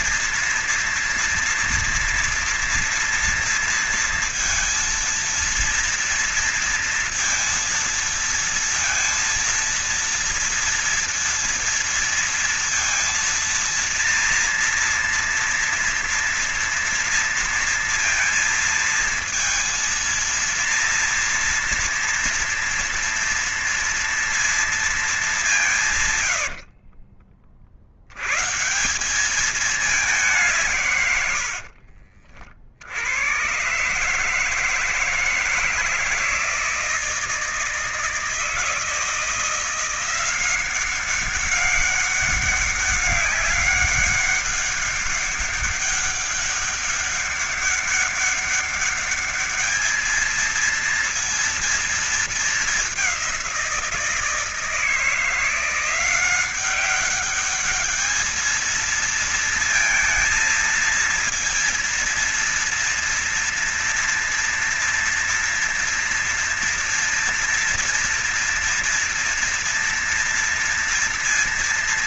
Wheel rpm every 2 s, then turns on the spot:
230, 230, 230, 230, 230, 230, 230, 240, 230, 230, 230, 230, 220, 70, 190, 120, 80, 160, 160, 170, 190, 200, 200, 200, 210, 230, 190, 170, 200, 230, 230, 230, 230, 230, 230, 230.
26-28 30-32